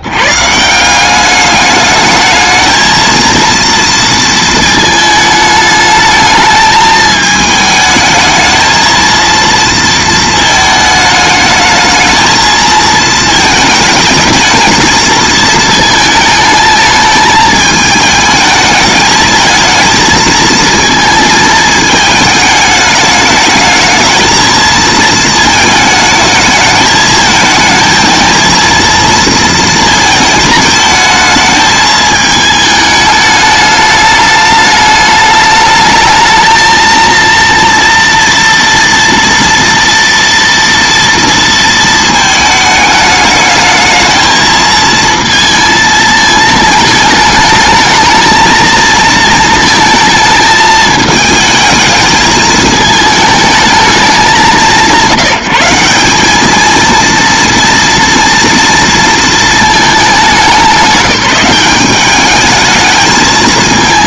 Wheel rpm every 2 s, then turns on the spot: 120, 220, 220, 220, 220, 220, 220, 220, 220, 220, 220, 210, 220, 220, 230, 220, 210, 210, 220, 230, 230, 210, 220, 220, 230, 220, 220, 170, 220, 230, 180, 220.
none